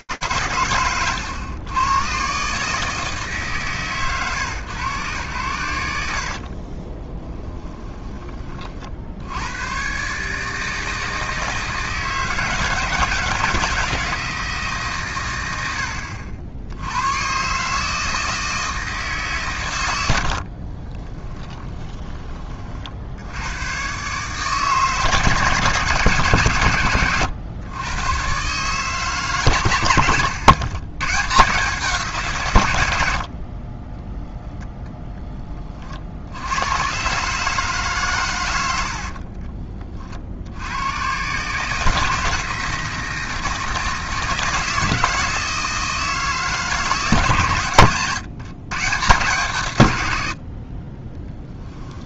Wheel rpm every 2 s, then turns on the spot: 120, 150, 110, 20, 90, 160, 160, 90, 140, 130, 20, 100, 160, 120, 130, 140, 30, 30, 140, 30, 130, 160, 160, 150, 130, 10.
6-8 20-22 38-40 50-52